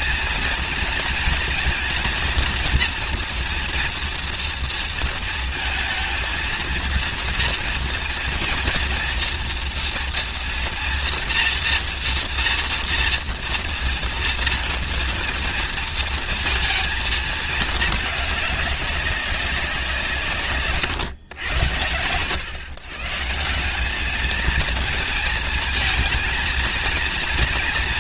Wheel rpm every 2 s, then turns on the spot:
240, 230, 230, 230, 230, 230, 230, 230, 230, 200, 130, 120, 220, 230.
none